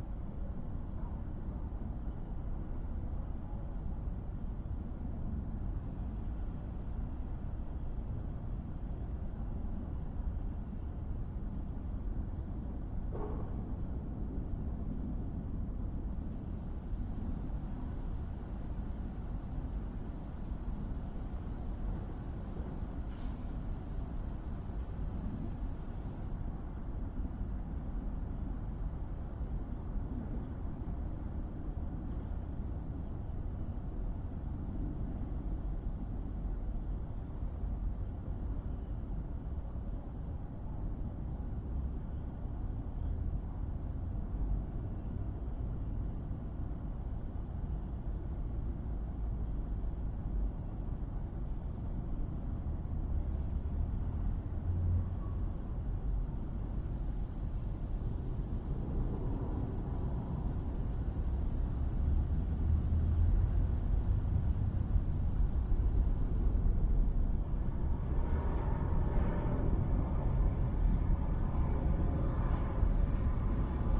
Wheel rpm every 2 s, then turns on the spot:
0, 0, 0, 0, 0, 0, 0, 0, 0, 0, 0, 0, 0, 0, 0, 0, 0, 0, 0, 0, 0, 0, 0, 0, 0, 0, 0, 0, 0, 0, 0, 0, 0, 0, 0, 0, 0.
none